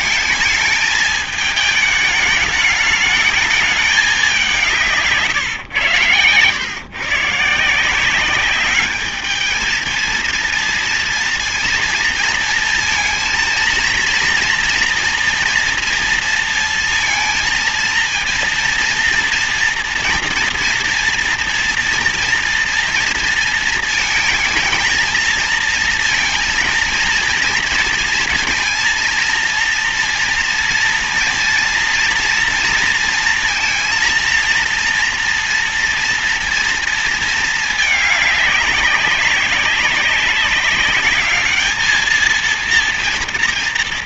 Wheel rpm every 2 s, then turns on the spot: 220, 210, 190, 120, 190, 230, 230, 240, 230, 230, 240, 240, 220, 230, 240, 230, 230, 230, 230, 210, 200, 220.
none